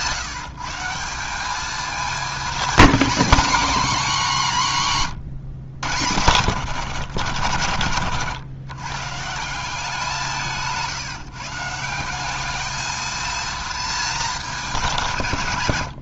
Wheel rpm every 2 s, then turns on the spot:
170, 220, 150, 130, 120, 160, 220, 190.
none